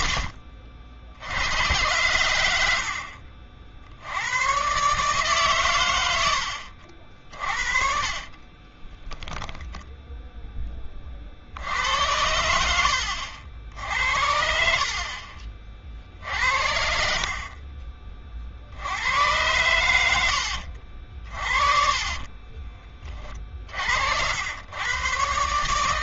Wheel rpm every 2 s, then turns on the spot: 50, 70, 130, 70, 20, 10, 80, 60, 70, 70, 70, 40, 100.
8-10 20-22